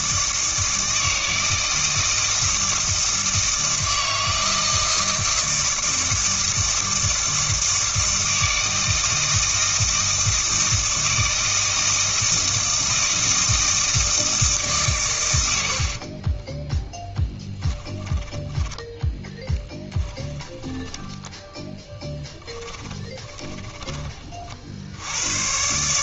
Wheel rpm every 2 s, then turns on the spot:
160, 160, 160, 160, 160, 160, 160, 130, 10, 20, 20, 10, 70.
16-24